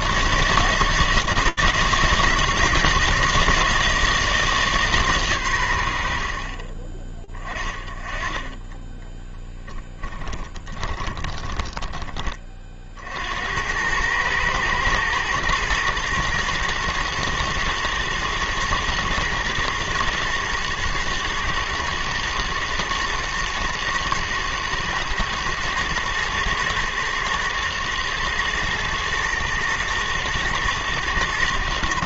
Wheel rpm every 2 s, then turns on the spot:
130, 170, 160, 50, 20, 20, 40, 110, 110, 110, 110, 110, 110, 110, 110, 110.
10-12